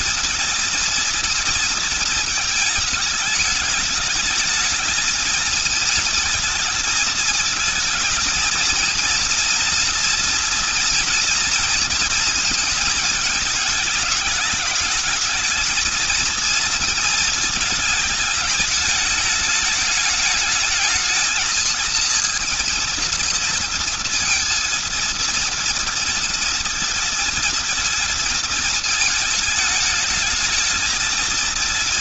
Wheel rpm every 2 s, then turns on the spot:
230, 220, 220, 230, 230, 230, 230, 210, 220, 210, 220, 230, 230, 230, 230, 210.
none